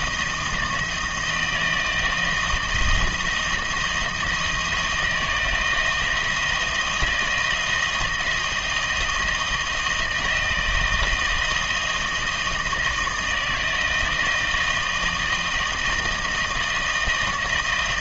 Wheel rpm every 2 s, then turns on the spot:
160, 170, 170, 170, 160, 160, 160, 160, 160.
none